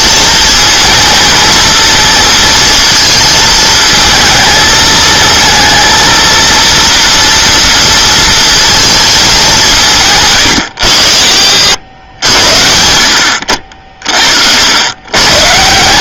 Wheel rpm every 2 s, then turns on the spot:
230, 230, 220, 230, 220, 110, 80, 90.
none